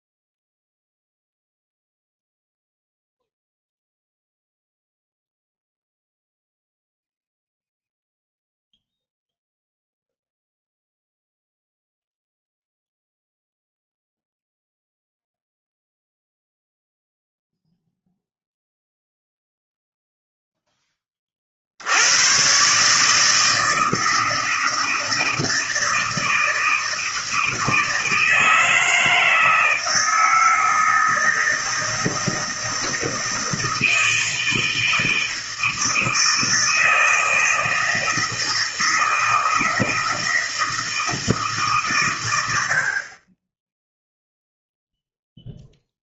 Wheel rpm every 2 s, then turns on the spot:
0, 0, 0, 0, 0, 0, 0, 0, 0, 0, 0, 120, 160, 160, 160, 160, 160, 160, 160, 160, 160, 90, 0.
none